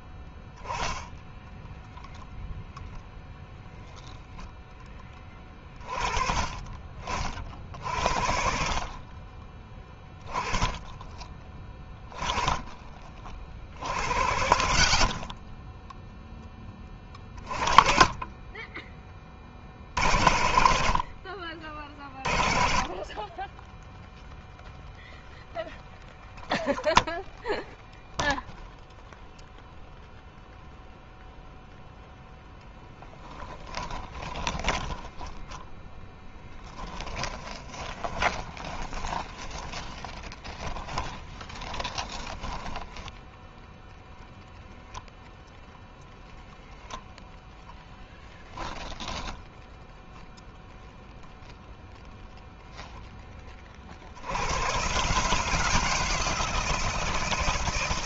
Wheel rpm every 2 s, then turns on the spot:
10, 0, 10, 30, 40, 20, 20, 60, 20, 20, 50, 30, 0, 0, 0, 0, 0, 20, 10, 20, 10, 10, 0, 0, 10, 0, 10, 120, 160.
34-44